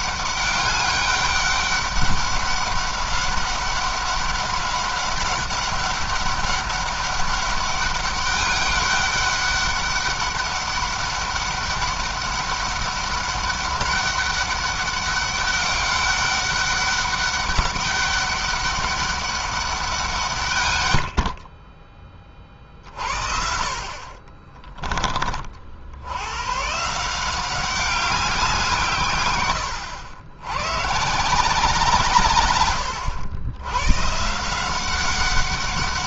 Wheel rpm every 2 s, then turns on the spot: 200, 190, 200, 200, 200, 200, 200, 200, 200, 200, 110, 40, 20, 150, 130, 140, 110, 180.
none